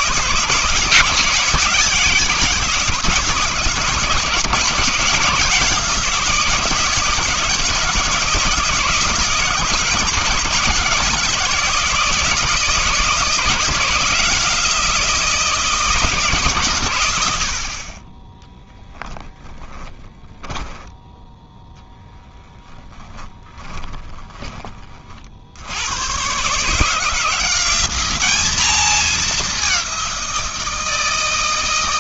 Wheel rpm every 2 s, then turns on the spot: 170, 160, 170, 160, 160, 160, 170, 170, 120, 10, 10, 10, 30, 140, 210, 170.
20-24